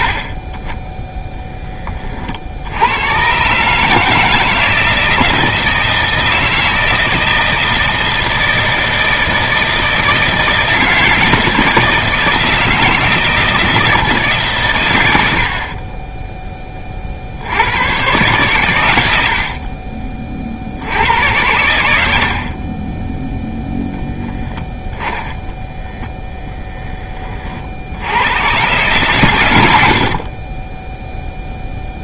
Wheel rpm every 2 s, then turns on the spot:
30, 90, 160, 160, 160, 160, 170, 110, 30, 110, 70, 30, 20, 20, 120, 10.
24-26